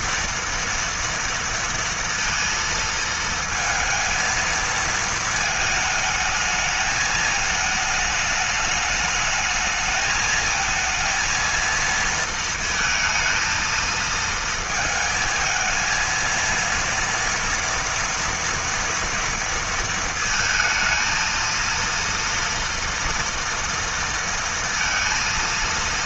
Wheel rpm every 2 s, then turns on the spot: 230, 230, 220, 220, 220, 230, 230, 220, 230, 230, 230, 230, 230.
none